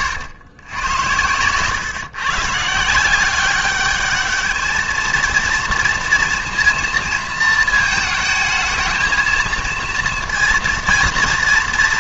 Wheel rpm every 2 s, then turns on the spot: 110, 140, 220, 230, 220, 230.
none